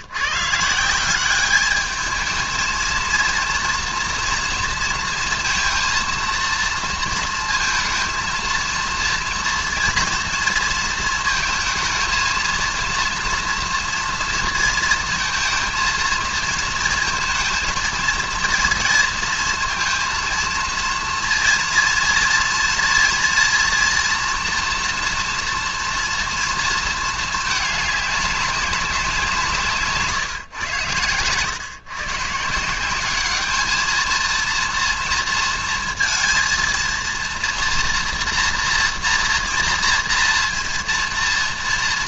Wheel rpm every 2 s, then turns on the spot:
150, 220, 230, 230, 230, 230, 230, 230, 230, 230, 230, 230, 240, 230, 200, 120, 170, 230, 230, 230, 230.
none